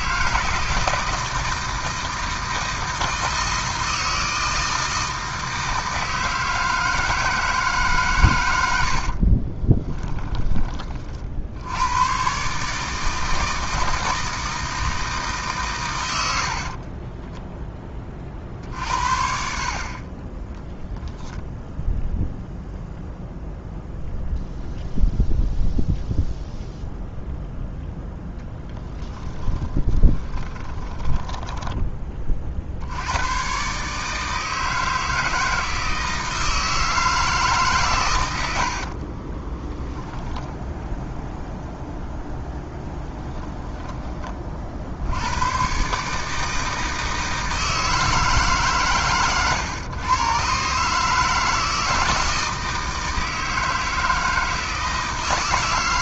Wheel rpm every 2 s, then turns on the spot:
160, 160, 160, 160, 80, 30, 150, 160, 50, 50, 0, 0, 0, 0, 10, 20, 70, 160, 160, 70, 0, 10, 50, 160, 140, 140, 160, 160.
8-10 16-18 28-32 38-40 42-44